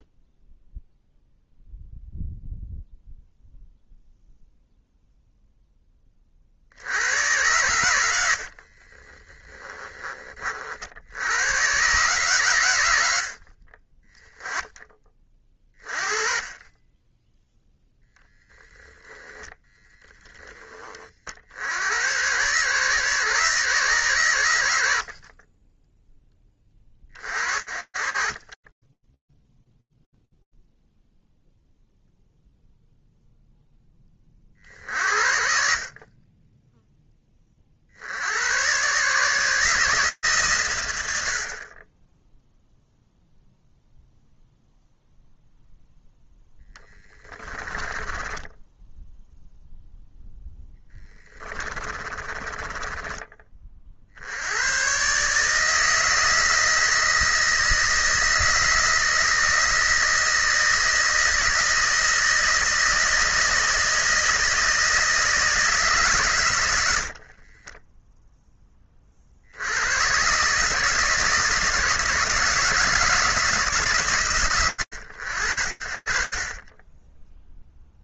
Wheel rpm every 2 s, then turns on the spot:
0, 0, 0, 40, 70, 30, 100, 20, 20, 10, 20, 120, 70, 20, 10, 0, 0, 50, 10, 130, 90, 0, 0, 10, 0, 10, 20, 130, 160, 160, 160, 160, 160, 70, 30, 150, 160, 140, 40.
8-10 46-48 50-54 66-68